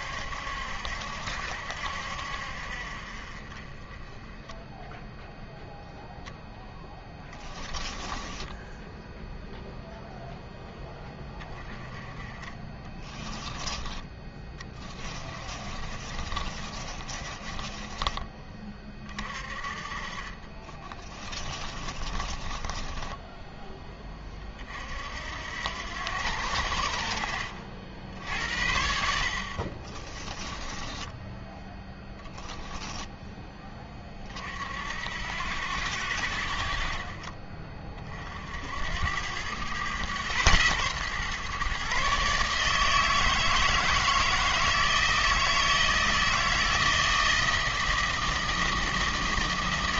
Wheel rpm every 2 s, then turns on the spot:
70, 50, 0, 10, 10, 20, 30, 20, 30, 30, 40, 10, 50, 60, 60, 10, 0, 70, 40, 80, 120, 150, 160, 160, 160.
8-10 12-18 20-24 30-32